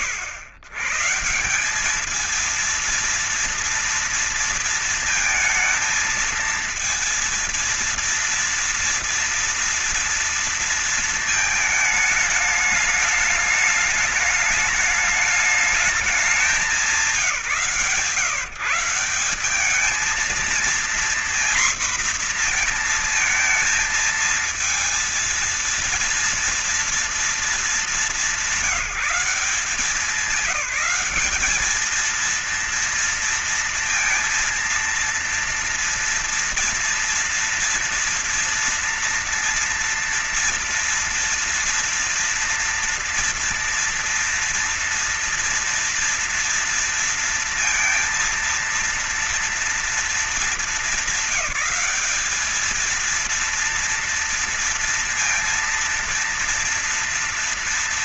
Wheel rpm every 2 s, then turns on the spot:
90, 220, 230, 220, 230, 230, 210, 210, 190, 160, 230, 230, 230, 230, 190, 190, 230, 230, 230, 230, 230, 230, 230, 230, 230, 210, 220, 230, 230.
none